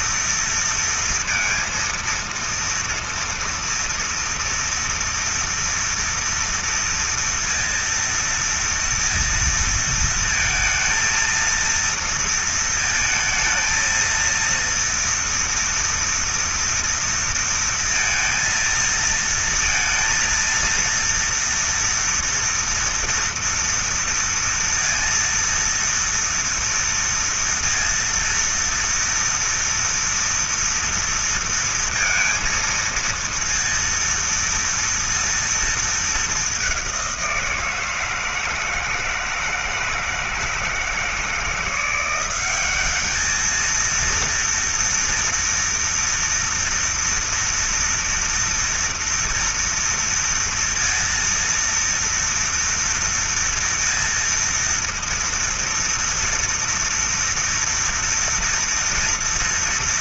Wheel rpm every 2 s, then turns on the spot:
230, 230, 230, 230, 230, 220, 230, 230, 230, 230, 230, 230, 230, 230, 230, 230, 230, 230, 200, 160, 160, 200, 230, 230, 230, 230, 230, 230, 230, 230.
none